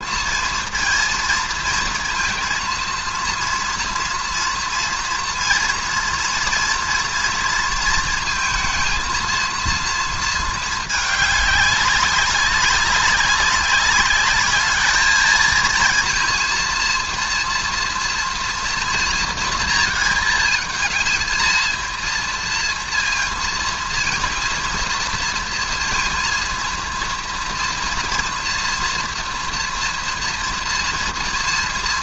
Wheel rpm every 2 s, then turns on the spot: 230, 230, 240, 230, 230, 220, 190, 210, 230, 230, 220, 230, 230, 230, 230, 230.
none